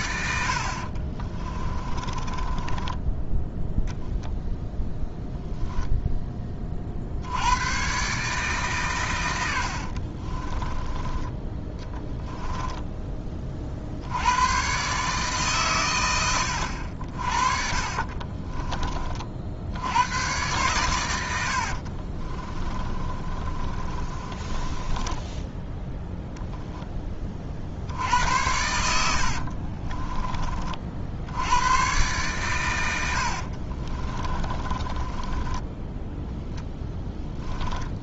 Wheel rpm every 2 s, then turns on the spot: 60, 10, 0, 50, 130, 20, 10, 130, 60, 30, 120, 30, 20, 10, 80, 60, 110, 20, 10.
0-4 10-14 22-26 34-38